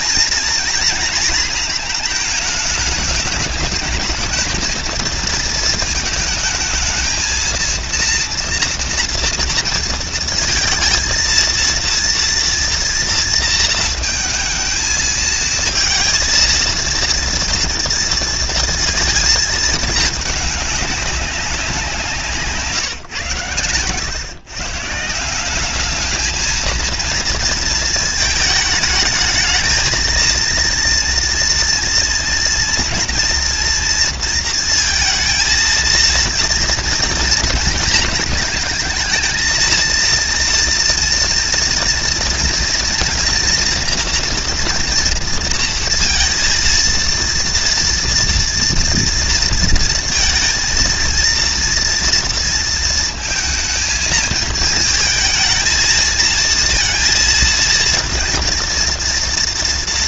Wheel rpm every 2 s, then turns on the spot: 230, 220, 220, 220, 230, 230, 230, 230, 230, 230, 210, 150, 140, 230, 210, 230, 230, 230, 230, 220, 230, 230, 240, 230, 230, 230, 230, 220, 230, 230.
none